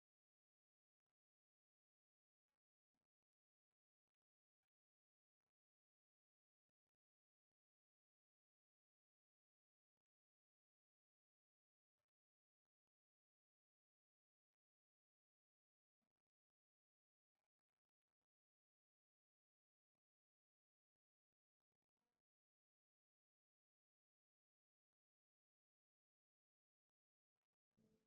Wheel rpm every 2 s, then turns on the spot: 0, 0, 0, 0, 0, 0, 0, 0, 0, 0, 0, 0, 0, 0.
none